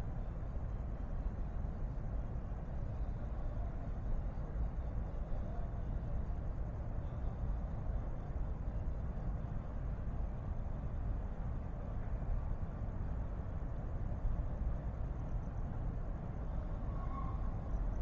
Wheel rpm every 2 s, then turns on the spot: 0, 0, 0, 0, 0, 0, 0, 0, 0.
none